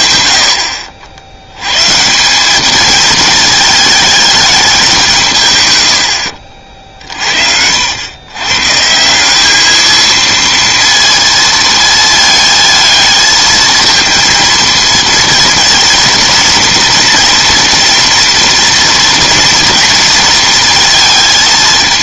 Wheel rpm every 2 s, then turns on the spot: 80, 200, 210, 60, 130, 230, 220, 230, 230, 230, 230.
none